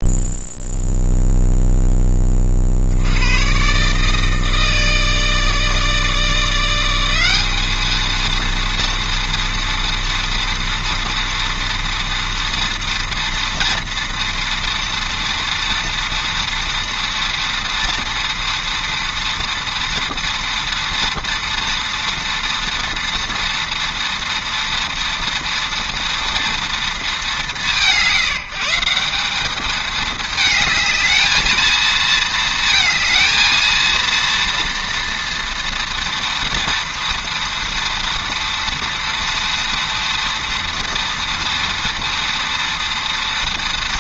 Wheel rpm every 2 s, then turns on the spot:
0, 60, 160, 180, 230, 230, 230, 230, 230, 230, 230, 230, 230, 220, 170, 220, 220, 230, 230, 230, 230, 230.
none